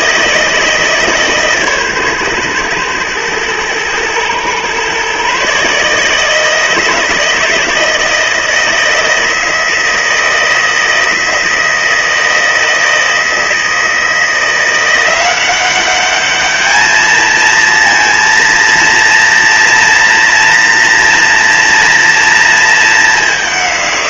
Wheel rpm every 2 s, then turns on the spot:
150, 110, 130, 160, 160, 160, 160, 170, 220, 230, 230, 210.
none